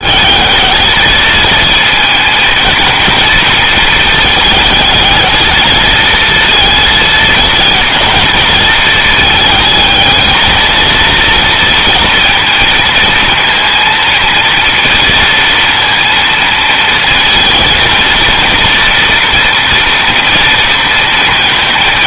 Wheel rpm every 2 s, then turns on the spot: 220, 230, 220, 220, 220, 230, 230, 230, 230, 230, 230.
none